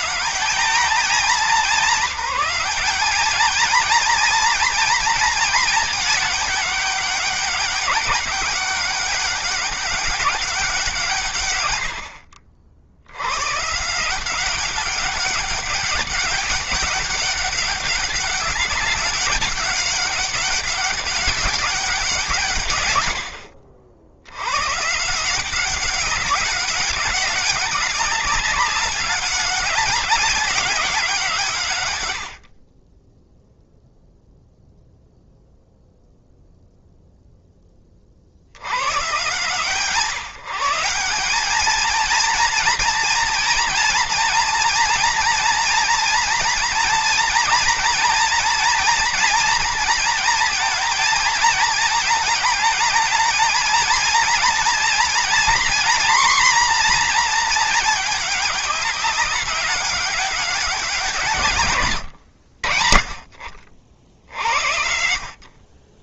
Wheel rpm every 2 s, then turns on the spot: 200, 200, 220, 200, 200, 170, 80, 200, 200, 200, 200, 140, 140, 190, 200, 180, 20, 0, 0, 100, 180, 230, 230, 230, 240, 220, 220, 240, 250, 200, 180, 70, 60.
none